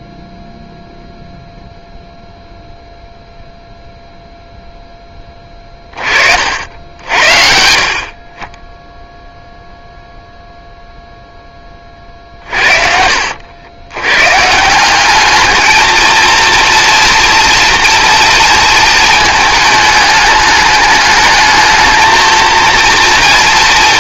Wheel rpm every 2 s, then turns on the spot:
0, 0, 0, 50, 20, 0, 50, 130, 230, 230, 210, 230.
none